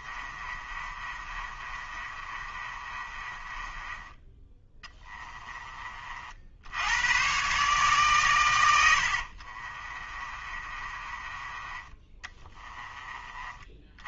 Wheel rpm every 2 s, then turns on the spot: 30, 30, 20, 80, 90, 30, 20.
0-6 8-14